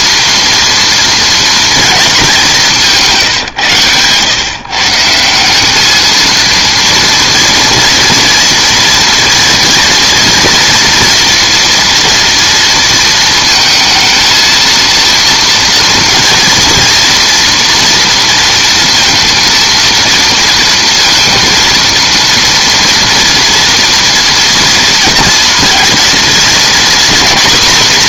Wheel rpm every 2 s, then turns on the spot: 230, 170, 160, 230, 240, 230, 230, 230, 230, 230, 230, 230, 230, 240.
none